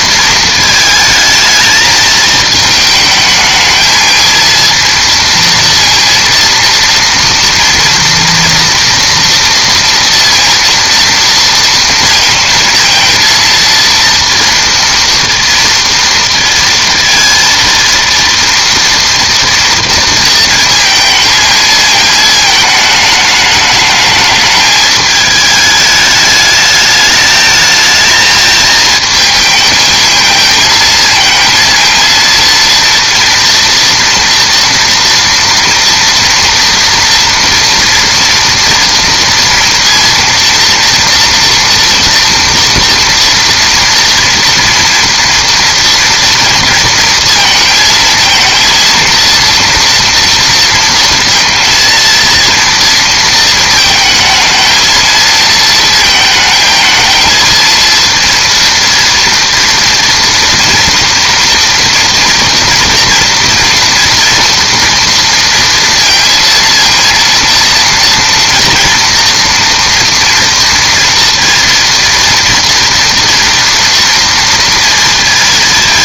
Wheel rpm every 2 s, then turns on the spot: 220, 220, 230, 230, 230, 230, 230, 230, 230, 230, 230, 210, 210, 210, 220, 220, 230, 230, 230, 230, 230, 230, 230, 230, 230, 230, 230, 220, 220, 230, 230, 230, 230, 230, 230, 230, 240, 230.
none